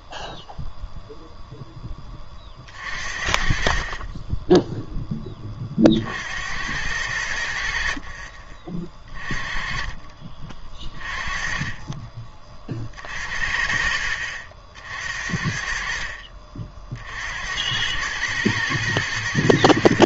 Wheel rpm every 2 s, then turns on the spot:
0, 50, 10, 80, 30, 30, 30, 50, 50, 110.
none